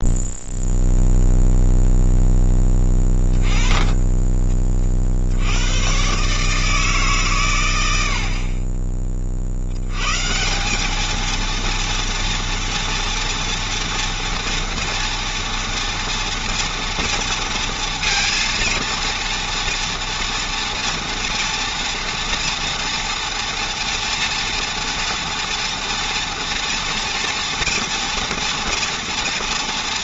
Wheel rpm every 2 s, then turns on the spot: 0, 10, 30, 150, 30, 210, 240, 230, 230, 230, 230, 230, 230, 240, 230.
none